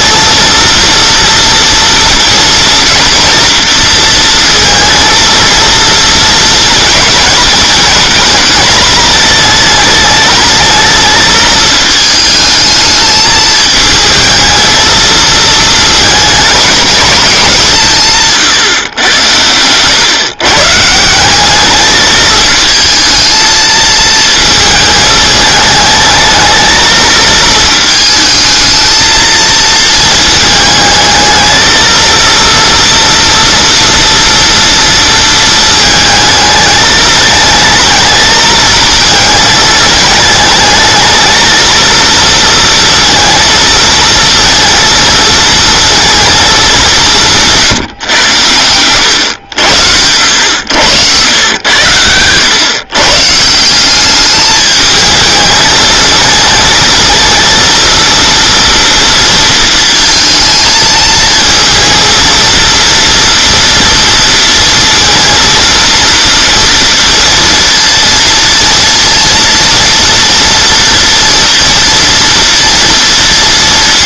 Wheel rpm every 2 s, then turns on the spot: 240, 230, 230, 220, 220, 220, 220, 220, 220, 140, 140, 220, 220, 220, 220, 220, 230, 230, 220, 230, 220, 230, 230, 210, 100, 100, 120, 210, 220, 230, 220, 230, 230, 230, 230, 230, 230.
50-52